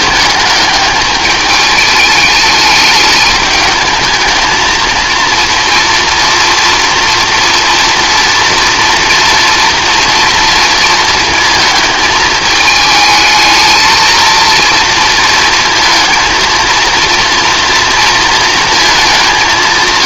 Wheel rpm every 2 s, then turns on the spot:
210, 210, 220, 240, 230, 230, 220, 230, 230, 220.
none